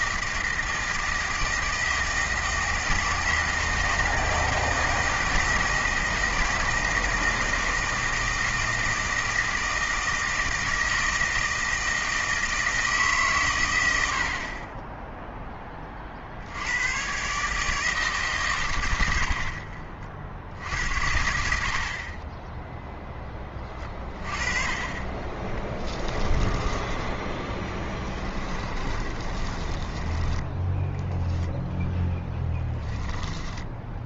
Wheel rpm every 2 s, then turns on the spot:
160, 160, 160, 160, 160, 160, 160, 20, 90, 110, 70, 10, 30, 20, 20, 10, 10.
26-30 32-34